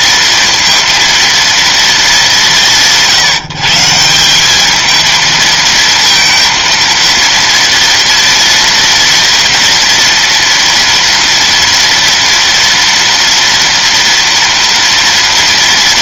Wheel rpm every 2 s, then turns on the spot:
230, 180, 210, 230, 230, 230, 230, 230.
none